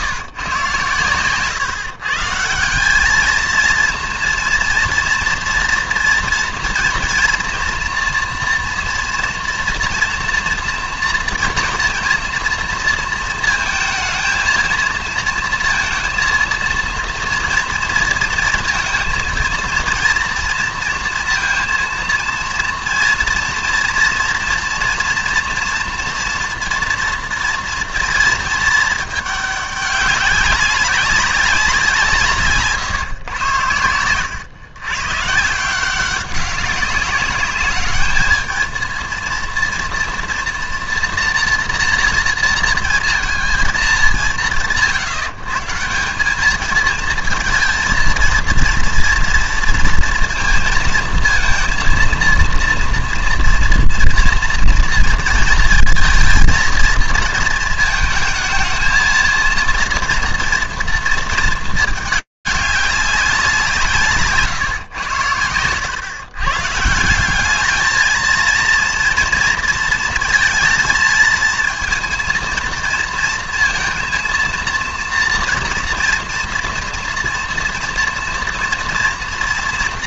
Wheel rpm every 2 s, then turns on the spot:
130, 180, 230, 230, 240, 230, 230, 230, 230, 230, 230, 230, 230, 230, 230, 200, 150, 110, 190, 220, 230, 230, 160, 210, 230, 230, 230, 230, 230, 220, 230, 200, 120, 150, 230, 230, 230, 230, 230, 230.
none